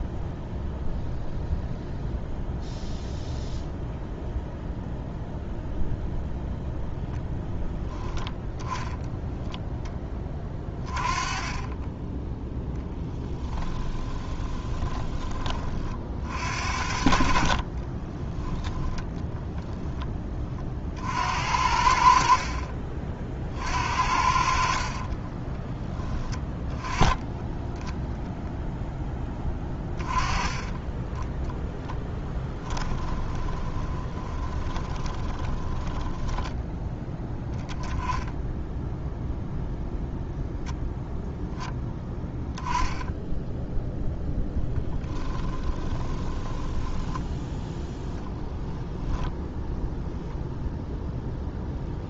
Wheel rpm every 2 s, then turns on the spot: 0, 0, 0, 0, 10, 30, 10, 20, 50, 10, 50, 40, 40, 10, 0, 20, 10, 20, 10, 0, 0, 10, 10, 10, 10, 0.
14-16 24-26 32-36 44-50